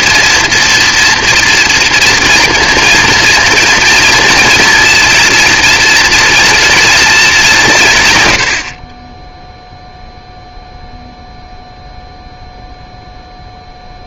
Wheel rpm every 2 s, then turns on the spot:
240, 230, 230, 230, 60, 0, 0.
none